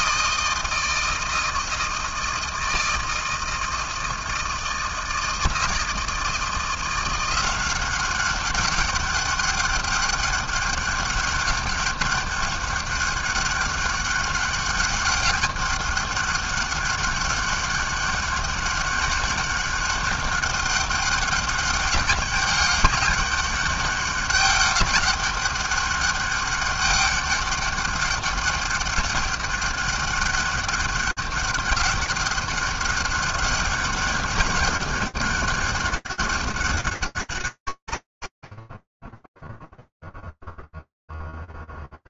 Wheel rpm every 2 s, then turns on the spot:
160, 160, 160, 160, 190, 200, 200, 200, 200, 200, 200, 200, 200, 200, 200, 200, 200, 200, 190, 10, 0.
none